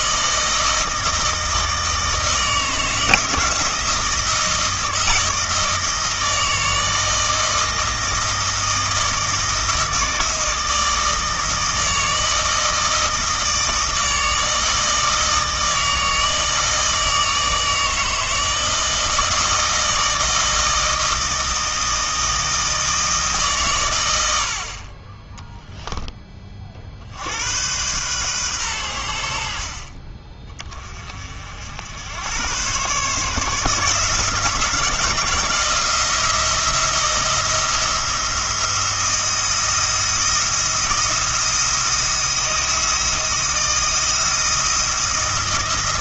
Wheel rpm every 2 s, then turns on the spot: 160, 160, 160, 160, 160, 160, 160, 160, 160, 160, 160, 160, 40, 30, 110, 30, 120, 160, 170, 170, 170, 170, 170.
none